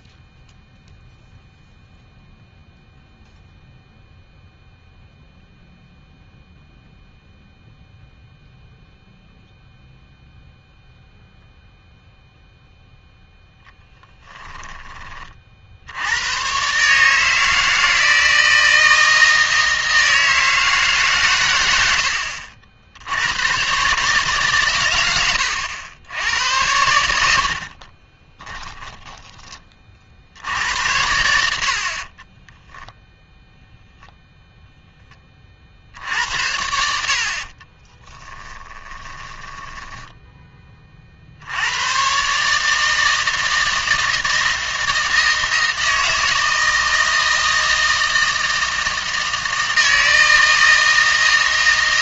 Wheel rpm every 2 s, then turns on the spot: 0, 0, 0, 0, 0, 0, 0, 10, 140, 160, 150, 70, 120, 90, 10, 80, 0, 0, 60, 10, 20, 150, 160, 160, 160, 160.
38-40